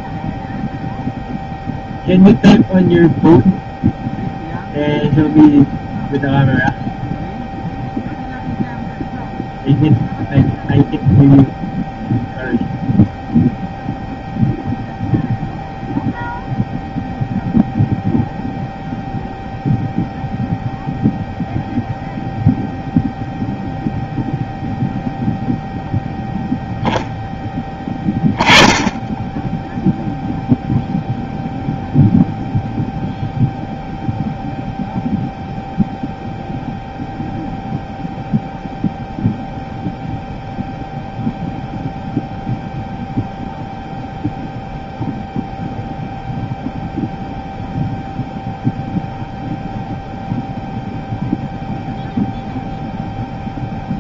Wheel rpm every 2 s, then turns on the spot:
0, 0, 0, 0, 0, 0, 0, 0, 0, 0, 0, 0, 0, 0, 10, 0, 0, 0, 0, 0, 0, 0, 0, 0, 0, 0, 0.
none